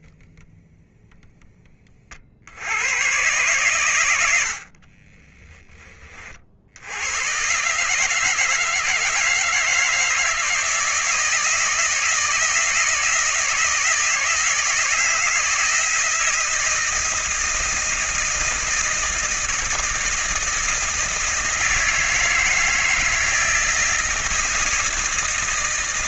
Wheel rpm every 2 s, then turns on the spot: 0, 100, 60, 80, 160, 160, 160, 160, 160, 160, 160, 170, 160.
4-6